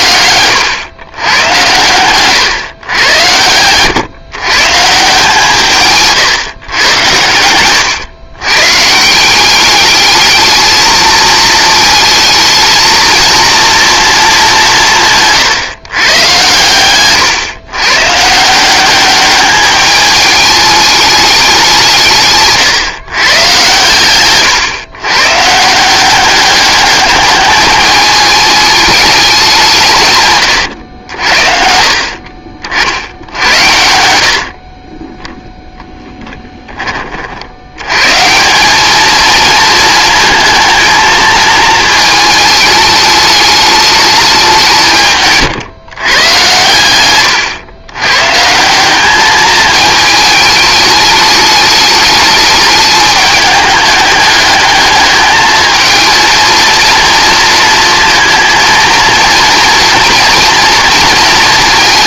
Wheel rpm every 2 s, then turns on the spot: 110, 120, 140, 110, 130, 220, 220, 180, 120, 190, 210, 140, 120, 210, 210, 100, 60, 30, 10, 190, 220, 210, 170, 120, 180, 210, 210, 210, 230, 230, 230.
30-32